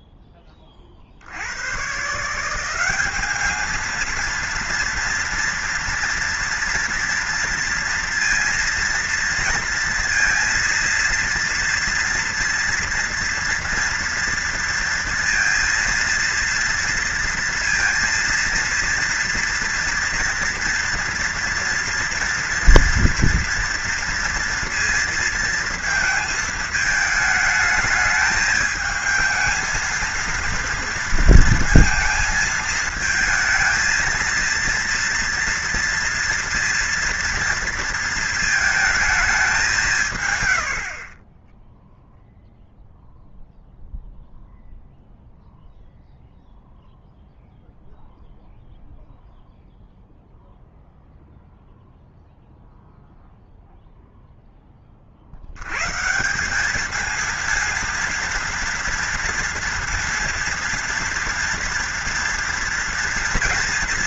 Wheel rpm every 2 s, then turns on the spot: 20, 180, 230, 240, 230, 230, 230, 230, 230, 240, 230, 230, 230, 220, 210, 230, 220, 240, 230, 220, 80, 0, 0, 0, 0, 0, 0, 10, 200, 230, 230, 230.
none